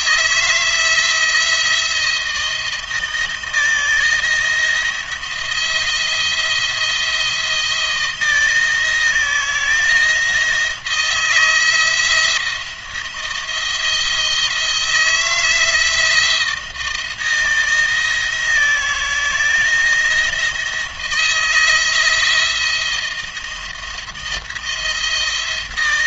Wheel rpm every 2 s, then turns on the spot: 160, 160, 160, 170, 160, 160, 170, 160, 170, 170, 170, 170, 170.
none